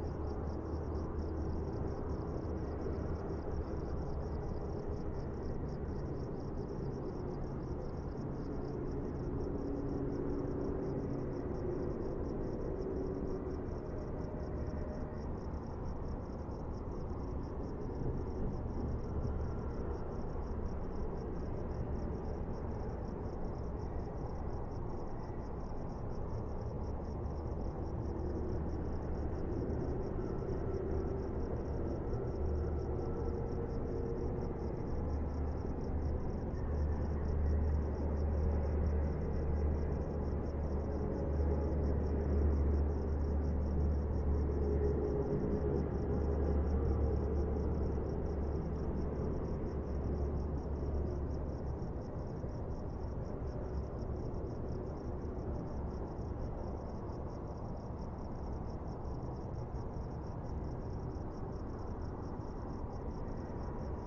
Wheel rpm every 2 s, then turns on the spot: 0, 0, 0, 0, 0, 0, 0, 0, 0, 0, 0, 0, 0, 0, 0, 0, 0, 0, 0, 0, 0, 0, 0, 0, 0, 0, 0, 0, 0, 0, 0, 0.
none